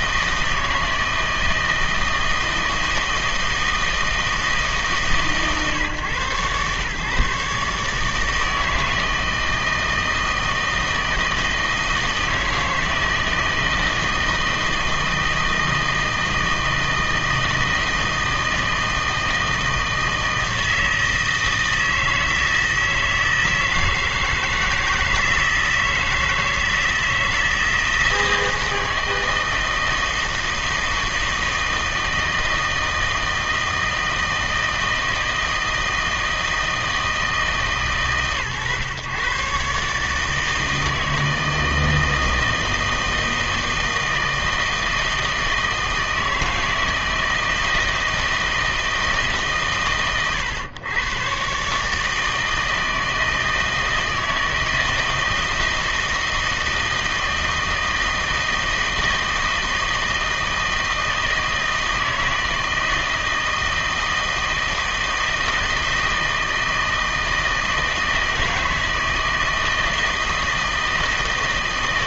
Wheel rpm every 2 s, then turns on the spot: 160, 160, 150, 130, 160, 160, 160, 160, 160, 160, 160, 160, 160, 160, 160, 160, 160, 160, 160, 120, 160, 160, 160, 160, 160, 110, 160, 160, 160, 160, 160, 160, 160, 160, 160, 160.
none